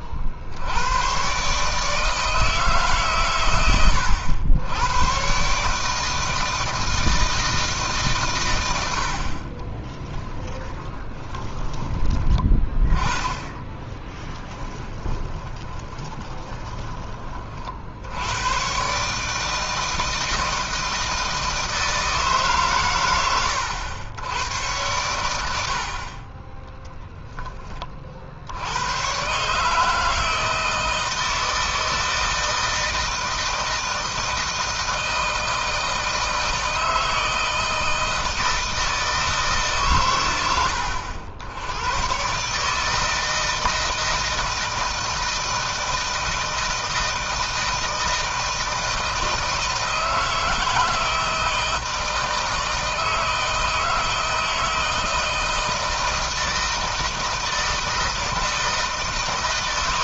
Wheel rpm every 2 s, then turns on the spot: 70, 160, 100, 160, 110, 10, 20, 20, 20, 120, 160, 140, 100, 30, 70, 160, 160, 160, 160, 160, 100, 140, 160, 160, 160, 160, 160, 160, 160, 160.
10-12 14-18 26-28